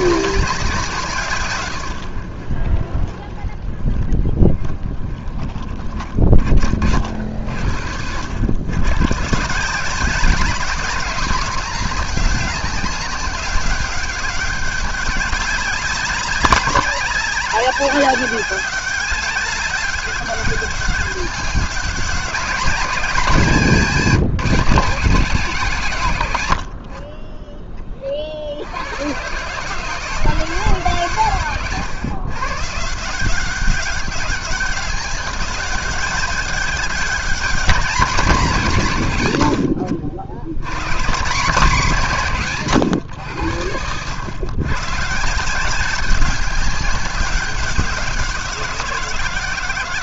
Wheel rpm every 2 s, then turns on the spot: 120, 30, 30, 70, 150, 210, 200, 200, 200, 200, 200, 210, 180, 20, 130, 130, 180, 200, 200, 130, 140, 100, 150, 190, 180.
none